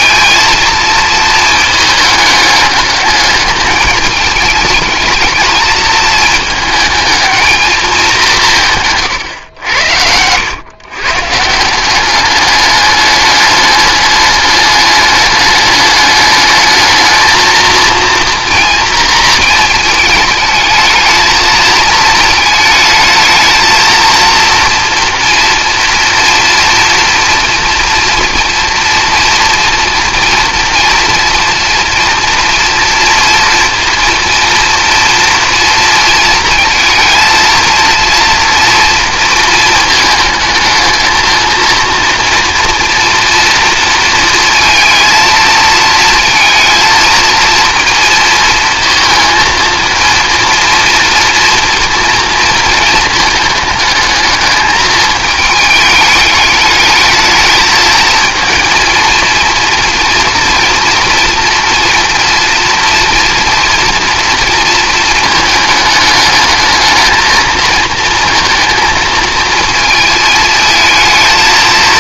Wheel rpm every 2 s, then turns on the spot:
230, 210, 210, 220, 140, 120, 210, 210, 210, 230, 220, 220, 230, 230, 240, 230, 230, 230, 220, 230, 220, 230, 230, 220, 230, 230, 220, 220, 210, 230, 230, 230, 220, 210, 230, 220.
none